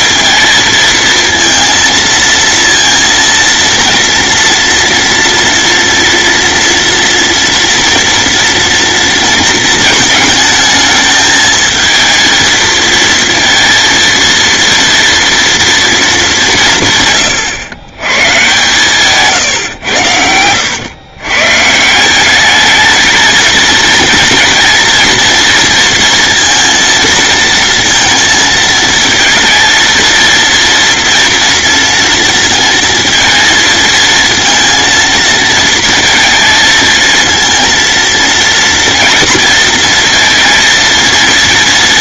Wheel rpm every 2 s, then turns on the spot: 230, 230, 230, 230, 230, 220, 230, 230, 150, 140, 110, 220, 230, 230, 230, 240, 230, 230, 230, 230, 230.
none